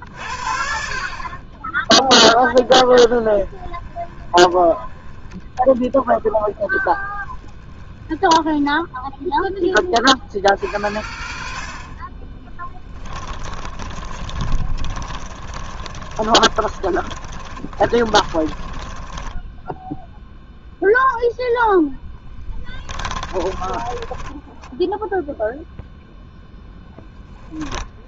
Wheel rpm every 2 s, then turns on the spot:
50, 10, 20, 10, 10, 50, 20, 30, 30, 30, 0, 10, 10, 0.
14-20 22-26